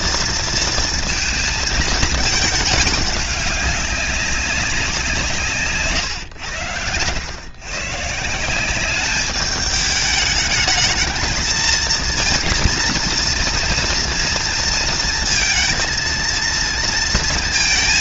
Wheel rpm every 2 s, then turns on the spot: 230, 200, 170, 110, 200, 220, 230, 230, 230.
none